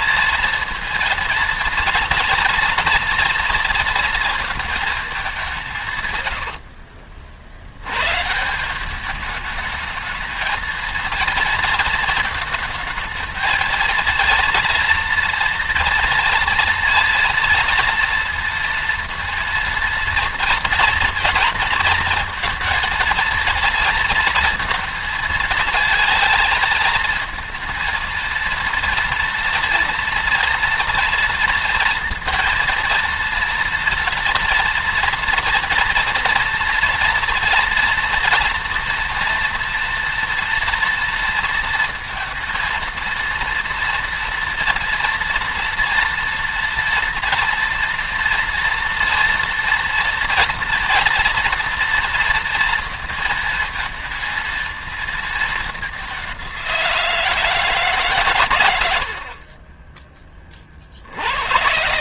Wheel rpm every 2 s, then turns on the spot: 230, 230, 230, 90, 170, 220, 220, 230, 230, 230, 230, 230, 230, 220, 230, 230, 230, 230, 230, 230, 230, 230, 230, 230, 230, 230, 230, 220, 180, 100, 30.
6-8